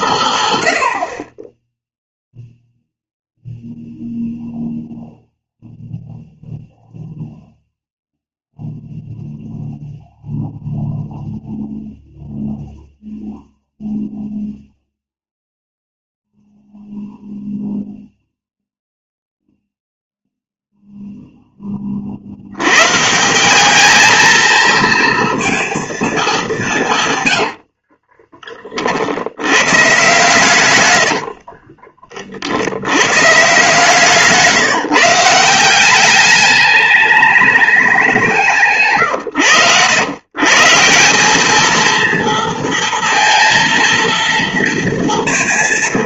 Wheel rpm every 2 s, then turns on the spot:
100, 0, 0, 0, 0, 0, 0, 0, 0, 0, 0, 120, 230, 180, 50, 110, 90, 170, 210, 140, 150, 230, 230.
30-32 38-40